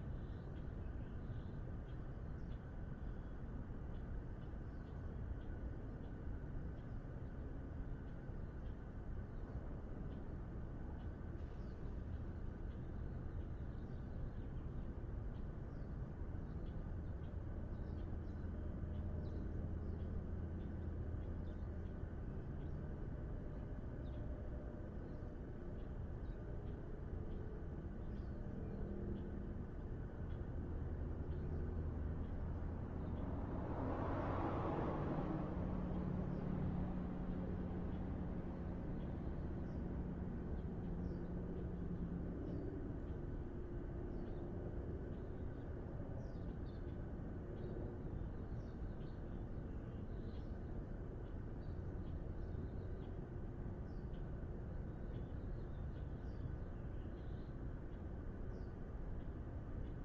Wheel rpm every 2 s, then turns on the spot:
0, 0, 0, 0, 0, 0, 0, 0, 0, 0, 0, 0, 0, 0, 0, 0, 0, 0, 0, 0, 0, 0, 0, 0, 0, 0, 0, 0, 0, 0.
none